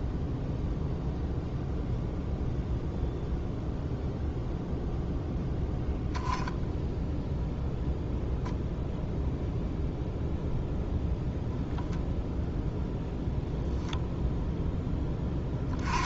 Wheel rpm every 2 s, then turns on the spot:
0, 0, 0, 0, 0, 0, 0, 10.
none